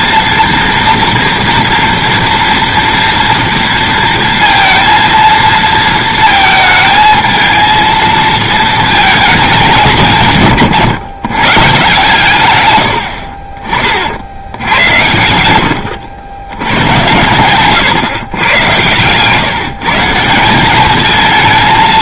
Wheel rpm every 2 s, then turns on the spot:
230, 230, 230, 220, 220, 130, 100, 80, 100, 120, 190.
12-14